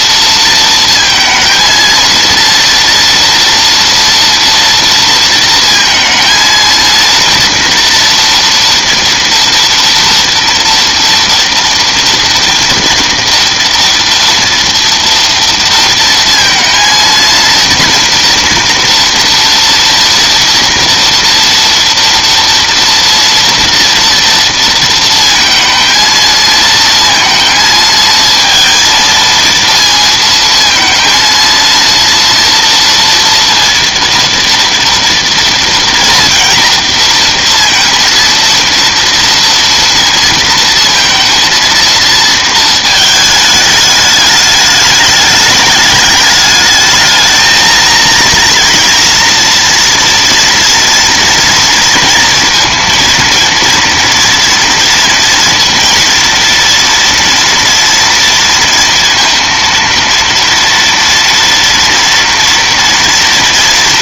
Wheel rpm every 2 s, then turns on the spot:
230, 230, 230, 230, 230, 230, 240, 230, 230, 230, 230, 230, 220, 220, 230, 230, 230, 230, 230, 230, 230, 210, 210, 230, 230, 230, 230, 240, 230, 230, 230, 230.
none